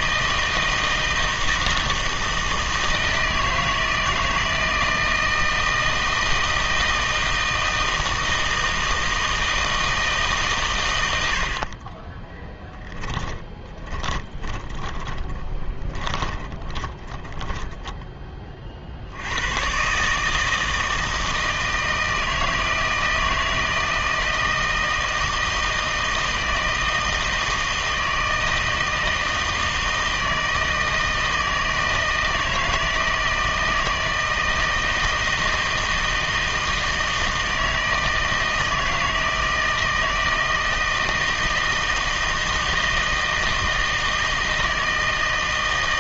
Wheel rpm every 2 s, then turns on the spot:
160, 160, 160, 160, 160, 130, 10, 20, 30, 40, 160, 160, 160, 160, 160, 160, 160, 160, 160, 160, 160, 160, 160.
12-18